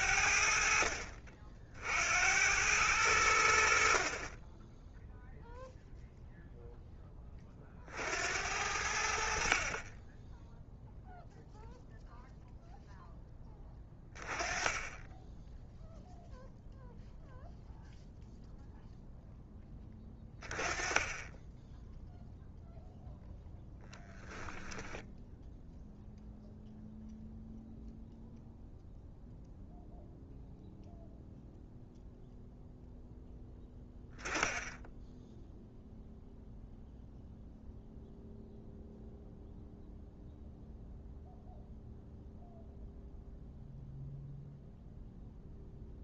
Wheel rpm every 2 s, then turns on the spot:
60, 90, 10, 10, 70, 0, 0, 10, 0, 0, 20, 0, 10, 0, 0, 0, 0, 0, 0, 0, 0, 0, 0.
24-26